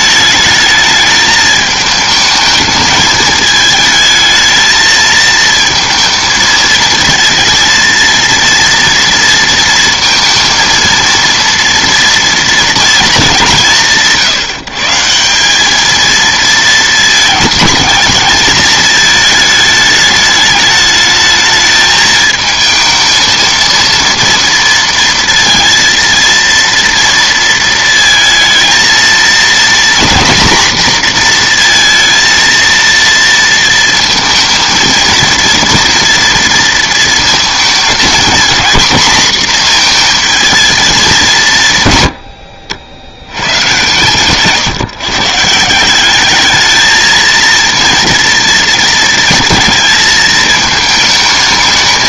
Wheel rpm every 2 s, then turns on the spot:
220, 210, 220, 230, 230, 230, 230, 170, 220, 220, 210, 220, 230, 230, 230, 240, 230, 230, 230, 220, 220, 100, 140, 220, 230, 220.
none